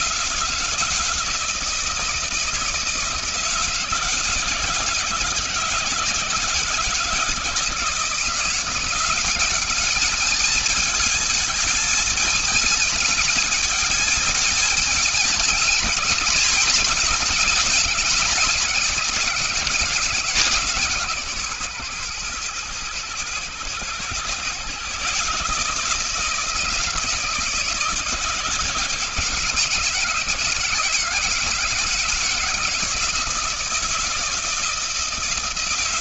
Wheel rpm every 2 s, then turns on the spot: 160, 160, 160, 160, 180, 220, 210, 210, 220, 190, 140, 120, 130, 160, 150, 160, 160, 160.
none